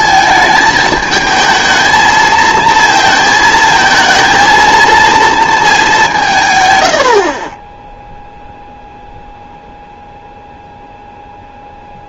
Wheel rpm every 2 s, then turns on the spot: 220, 220, 230, 120, 0, 0.
none